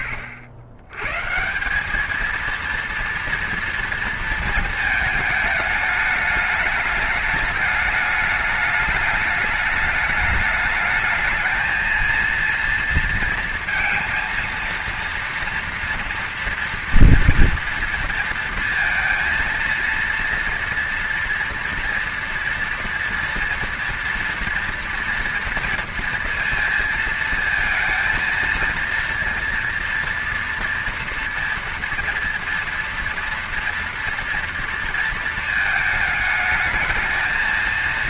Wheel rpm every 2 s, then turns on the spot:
110, 230, 220, 210, 210, 220, 230, 230, 230, 220, 240, 230, 230, 230, 230, 230, 230, 230, 220.
none